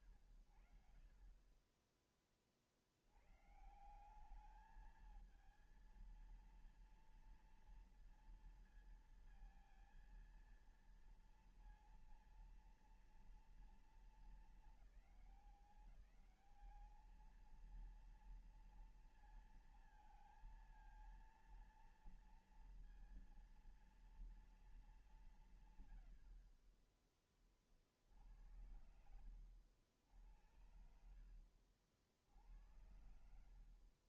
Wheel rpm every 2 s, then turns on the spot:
70, 30, 170, 230, 230, 230, 230, 220, 200, 230, 230, 230, 230, 50, 70, 80, 70.
none